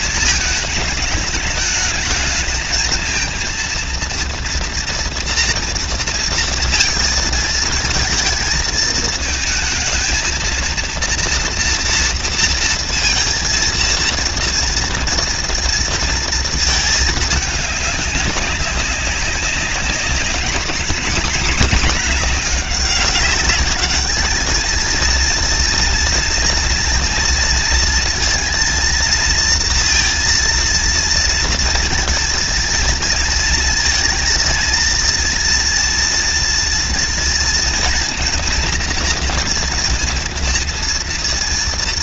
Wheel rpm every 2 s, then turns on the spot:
220, 220, 230, 230, 220, 230, 230, 230, 220, 190, 210, 200, 230, 240, 230, 230, 230, 230, 230, 230, 230.
none